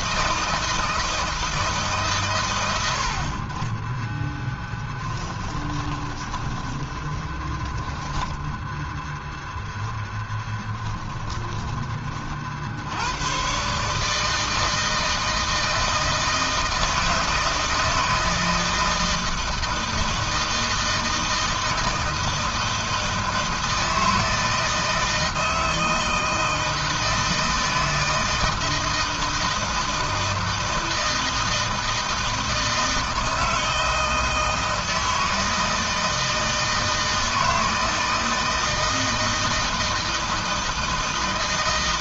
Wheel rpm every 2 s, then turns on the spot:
160, 110, 0, 20, 10, 10, 60, 160, 160, 160, 160, 160, 160, 160, 160, 160, 160, 160, 160, 160, 160.
6-12